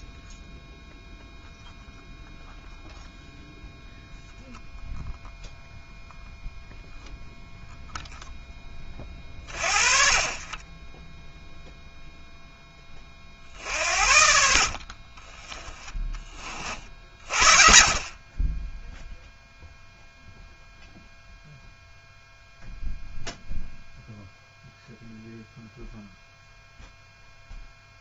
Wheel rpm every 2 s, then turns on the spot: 0, 0, 0, 0, 20, 10, 30, 50, 50, 0, 0, 0, 0, 0.
none